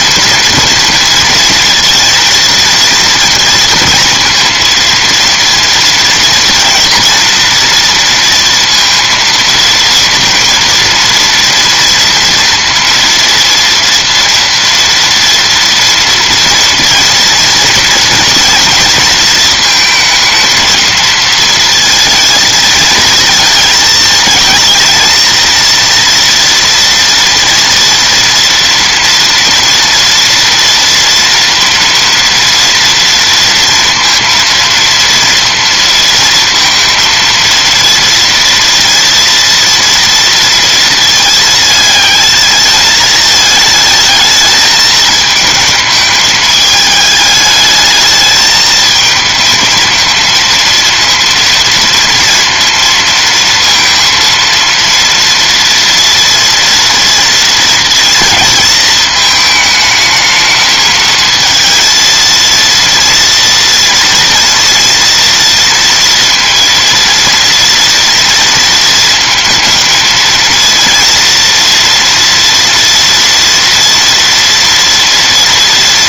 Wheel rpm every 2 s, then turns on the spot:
240, 230, 230, 230, 230, 230, 230, 230, 230, 230, 220, 220, 220, 230, 230, 230, 230, 230, 230, 230, 230, 220, 220, 210, 220, 230, 230, 230, 230, 230, 220, 230, 230, 230, 230, 230, 230, 230.
none